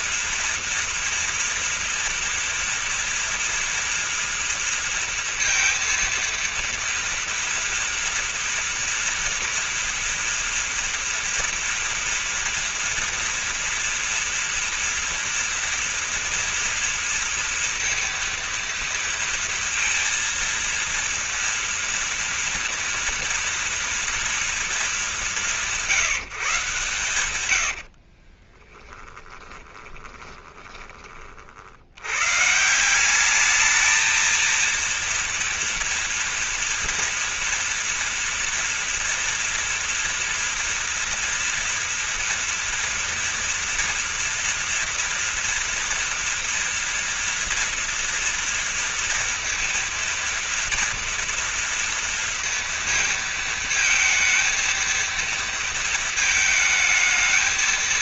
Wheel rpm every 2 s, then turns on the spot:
230, 230, 230, 230, 230, 240, 230, 240, 230, 230, 230, 230, 220, 130, 20, 30, 180, 230, 230, 230, 230, 230, 230, 230, 230, 230, 230, 230, 220.
28-30